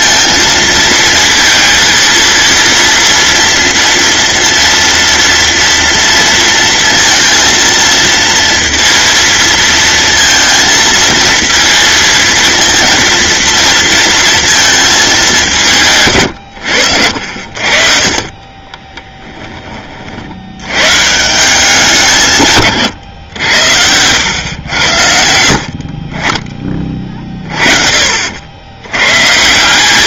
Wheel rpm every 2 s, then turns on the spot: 230, 230, 230, 230, 230, 230, 230, 220, 80, 30, 120, 130, 80, 30, 100.
18-20